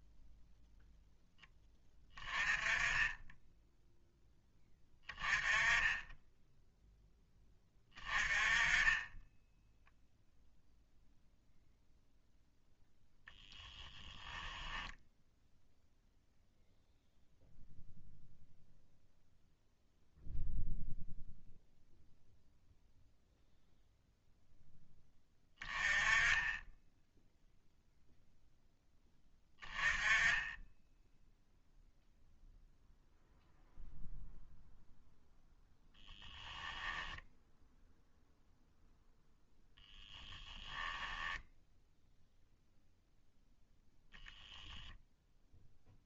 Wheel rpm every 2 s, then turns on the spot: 20, 10, 0, 20, 0, 0, 10, 0, 0, 0, 0, 10, 10, 10, 10, 0, 0, 10, 0, 10, 0, 0, 0.
12-14 34-36 38-40